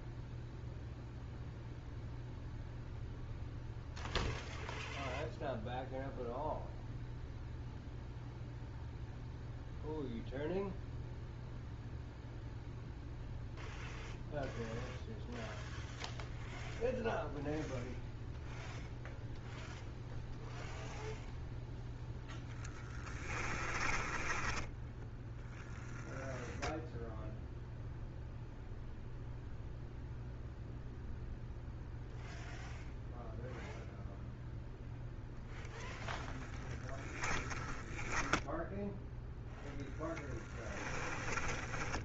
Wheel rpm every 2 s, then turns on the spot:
0, 0, 0, 0, 0, 0, 0, 0, 0, 0, 0, 20, 10, 10, 0, 0, 0, 0, 10, 0, 10.
22-26